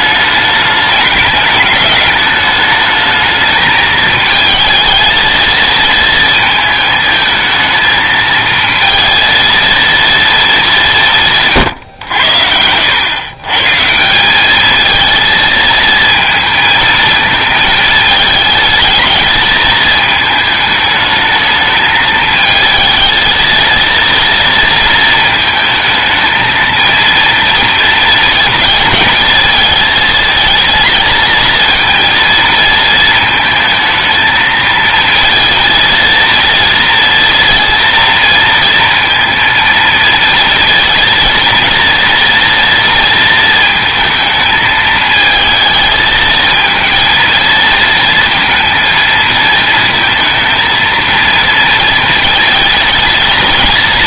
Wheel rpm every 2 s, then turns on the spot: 210, 210, 220, 230, 220, 230, 90, 190, 230, 220, 220, 220, 230, 220, 230, 220, 230, 220, 230, 230, 230, 230, 220, 220, 220, 230, 230.
none